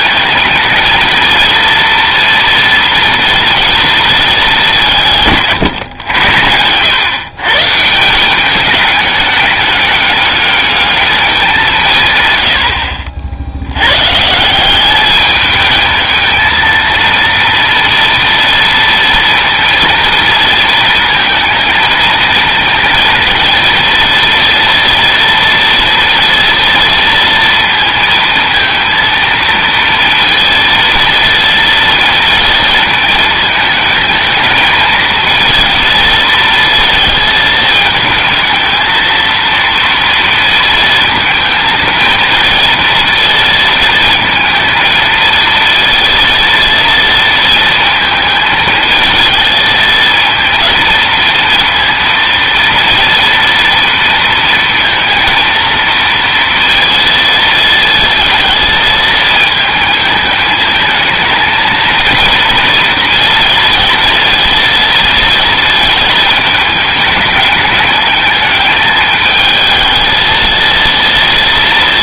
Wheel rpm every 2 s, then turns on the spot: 230, 230, 170, 100, 200, 210, 80, 200, 230, 230, 230, 230, 240, 230, 230, 230, 230, 220, 230, 220, 230, 230, 230, 230, 220, 230, 230, 230, 230, 220, 220, 230, 230, 220, 210, 230.
none